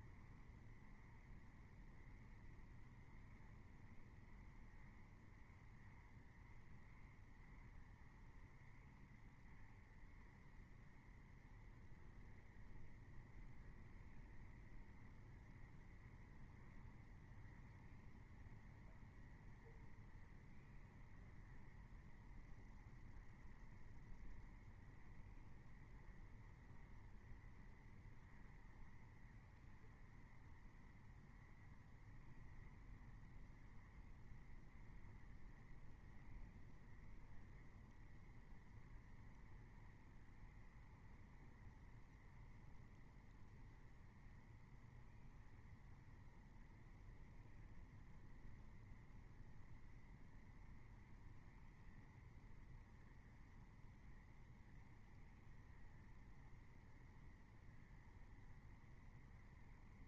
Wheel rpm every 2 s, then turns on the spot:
0, 0, 0, 0, 0, 0, 0, 0, 0, 0, 0, 0, 0, 0, 0, 0, 0, 0, 0, 0, 0, 0, 0, 0, 0, 0, 0, 0, 0, 0.
none